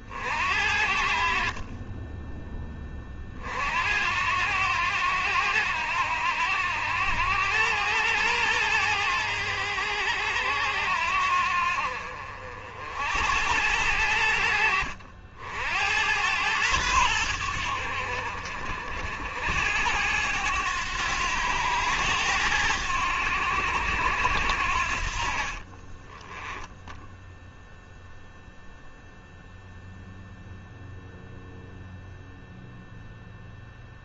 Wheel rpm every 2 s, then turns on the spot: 60, 20, 90, 90, 100, 80, 60, 80, 100, 60, 100, 90, 60, 0, 0, 0, 0.
none